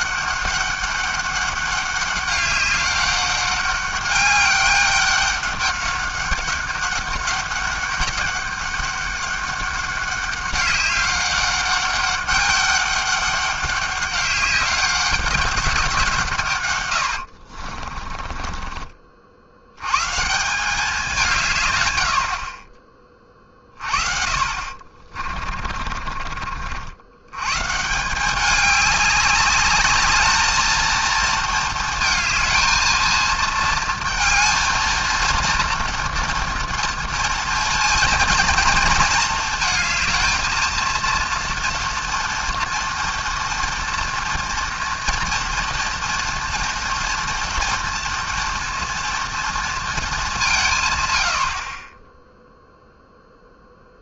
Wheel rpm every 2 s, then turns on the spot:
200, 200, 200, 200, 200, 200, 200, 190, 120, 30, 180, 40, 40, 70, 200, 220, 220, 220, 230, 230, 220, 230, 240, 230, 230, 160, 0.
18-20 24-26